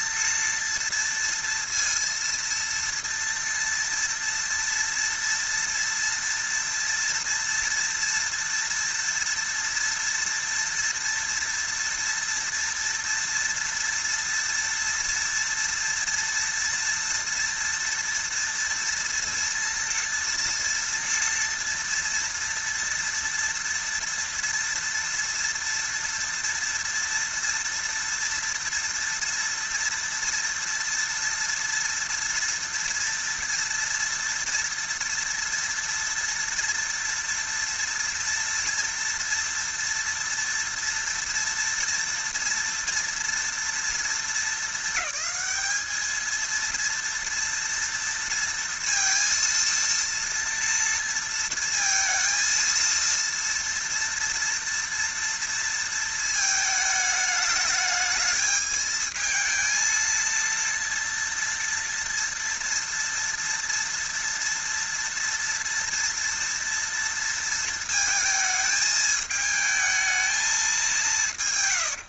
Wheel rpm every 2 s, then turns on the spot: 230, 230, 230, 230, 230, 230, 230, 230, 230, 230, 230, 230, 230, 230, 230, 230, 230, 230, 230, 230, 230, 230, 210, 230, 230, 230, 230, 230, 210, 220, 230, 230, 230, 230, 220, 190.
none